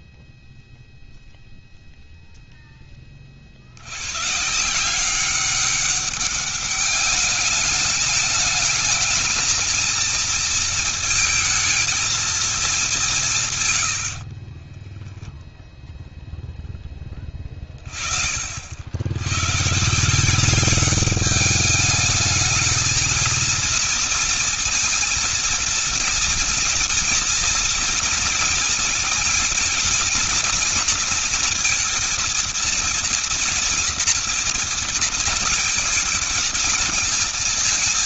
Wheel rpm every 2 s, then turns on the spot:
0, 10, 170, 210, 220, 230, 200, 20, 20, 80, 200, 220, 230, 230, 230, 240, 230, 230, 220.
14-16